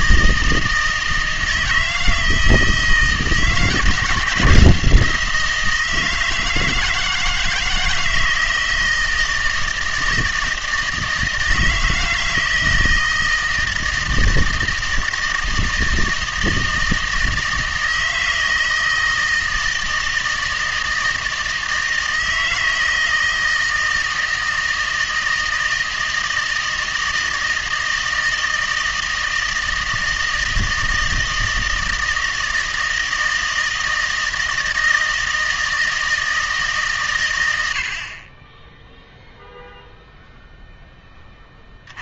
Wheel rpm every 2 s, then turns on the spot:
160, 160, 160, 160, 160, 160, 160, 160, 160, 160, 160, 160, 160, 160, 160, 160, 160, 160, 150, 10, 10.
none